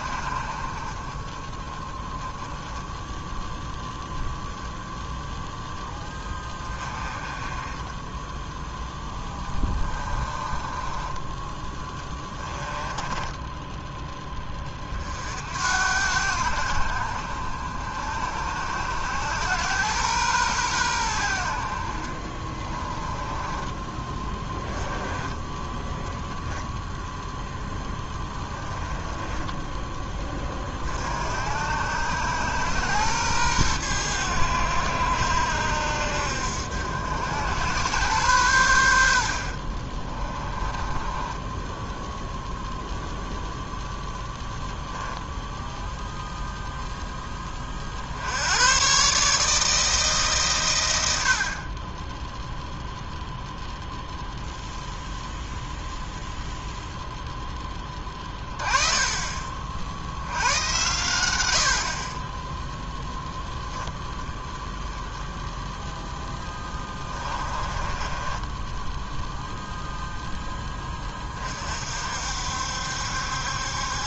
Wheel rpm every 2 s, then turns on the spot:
40, 0, 0, 20, 10, 20, 10, 40, 70, 90, 90, 20, 10, 0, 10, 50, 110, 80, 80, 80, 20, 0, 0, 10, 130, 80, 0, 0, 0, 30, 100, 0, 10, 20, 10, 20, 70.
8-14 22-24 28-30 40-42